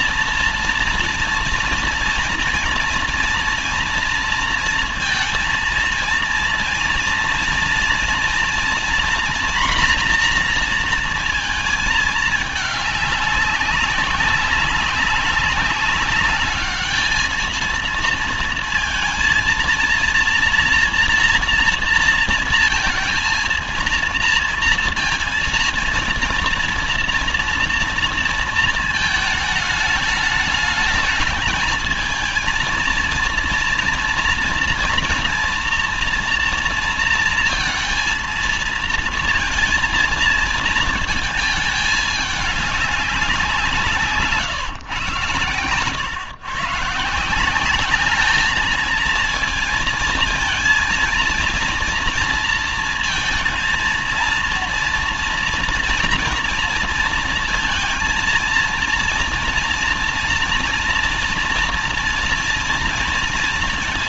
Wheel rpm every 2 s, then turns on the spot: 230, 230, 230, 230, 230, 240, 210, 200, 210, 230, 230, 230, 230, 240, 220, 220, 230, 230, 230, 230, 230, 210, 150, 140, 210, 230, 230, 230, 230, 230, 230, 230.
none